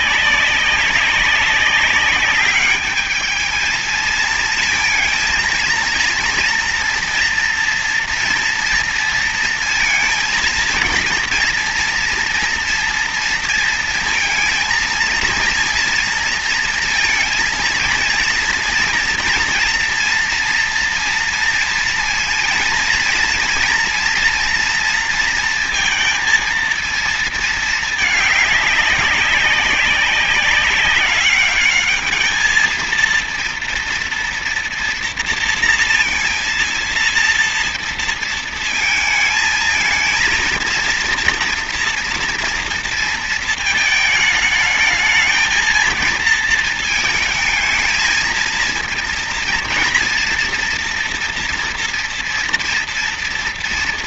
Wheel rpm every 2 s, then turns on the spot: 190, 200, 220, 230, 230, 230, 230, 230, 230, 230, 230, 230, 230, 230, 210, 200, 220, 230, 230, 230, 230, 230, 220, 230, 220, 230, 230.
none